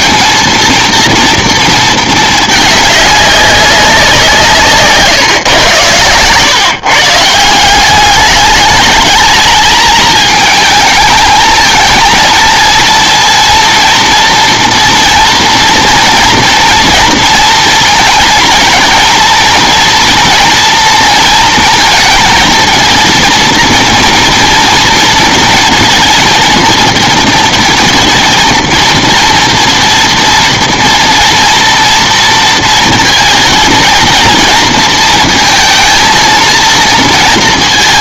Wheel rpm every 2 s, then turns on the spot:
230, 210, 160, 140, 210, 220, 230, 230, 230, 230, 230, 230, 230, 220, 230, 230, 230, 230, 230.
none